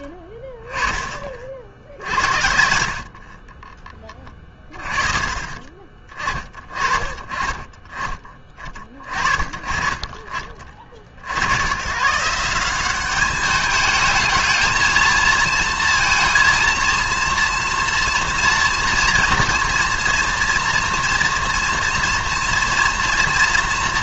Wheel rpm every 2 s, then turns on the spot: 10, 70, 30, 30, 30, 40, 180, 220, 230, 230, 230, 230.
none